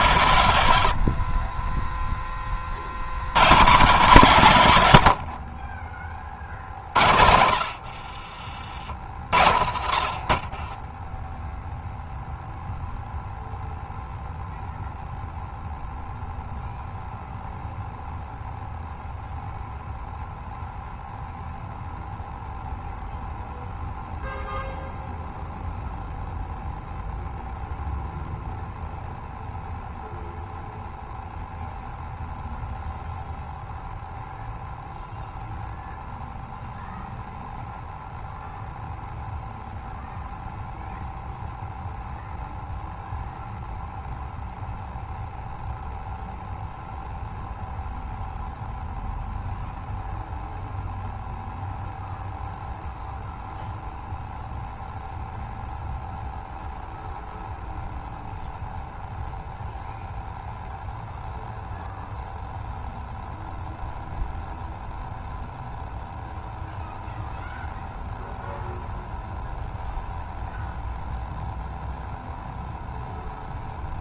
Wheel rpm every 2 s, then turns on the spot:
90, 40, 140, 50, 60, 20, 0, 0, 0, 0, 0, 0, 0, 0, 0, 0, 0, 0, 0, 0, 0, 0, 0, 0, 0, 0, 0, 0, 0, 0, 0, 0, 0, 0, 0, 0, 0.
8-12